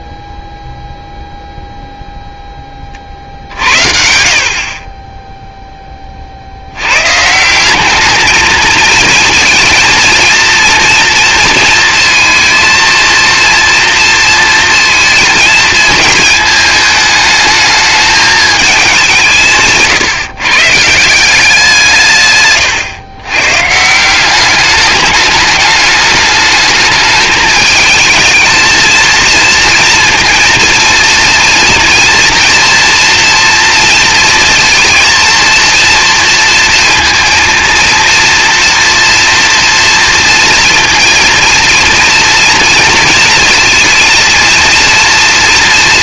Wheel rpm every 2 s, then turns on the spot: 0, 30, 40, 80, 230, 230, 230, 230, 220, 210, 150, 130, 200, 210, 230, 230, 230, 230, 230, 230, 230, 230, 230.
22-24